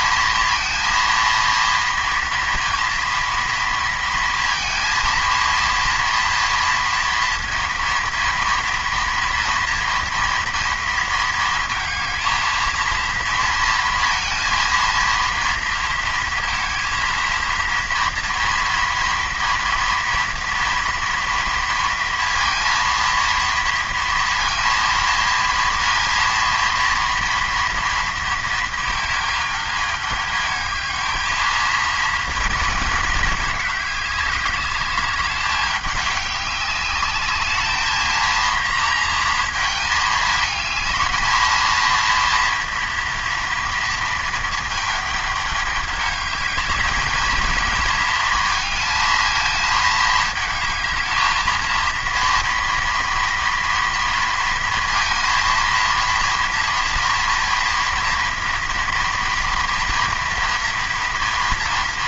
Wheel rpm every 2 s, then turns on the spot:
230, 230, 230, 230, 230, 230, 220, 230, 230, 230, 230, 230, 230, 230, 230, 210, 220, 200, 200, 230, 220, 230, 220, 220, 230, 220, 230, 230, 230, 240, 230.
none